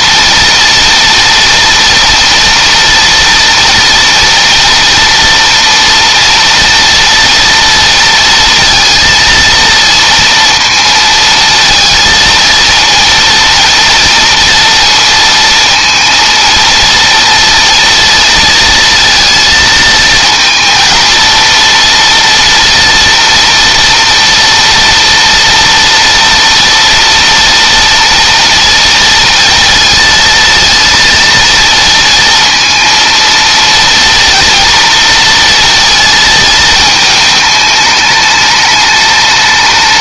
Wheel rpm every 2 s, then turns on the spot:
230, 230, 230, 230, 230, 230, 230, 230, 230, 230, 230, 230, 230, 230, 230, 230, 230, 230, 220, 210.
none